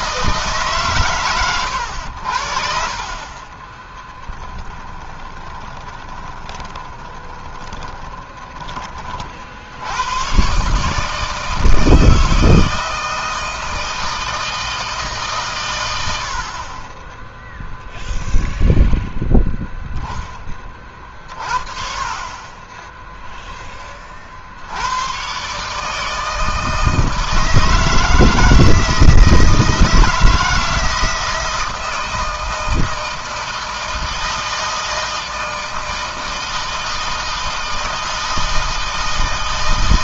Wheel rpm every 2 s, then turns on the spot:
130, 50, 20, 20, 30, 150, 160, 150, 10, 0, 30, 20, 90, 160, 160, 160, 160, 160, 160, 160.
4-8 22-24